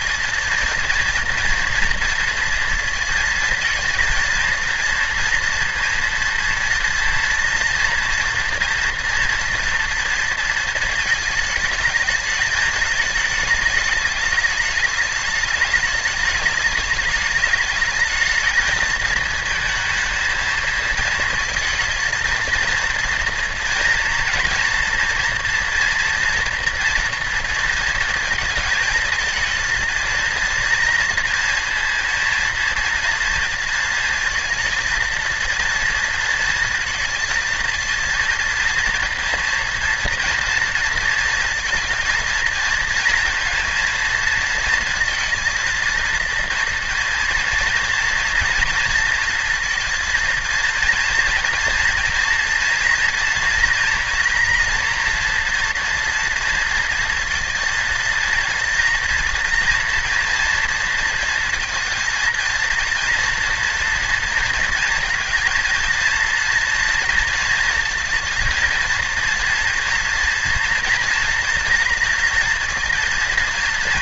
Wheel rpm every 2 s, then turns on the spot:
230, 230, 230, 230, 230, 220, 210, 210, 210, 220, 220, 230, 230, 230, 220, 230, 230, 230, 230, 230, 230, 230, 230, 230, 230, 230, 240, 240, 230, 230, 230, 230, 230, 230, 230, 240, 230.
none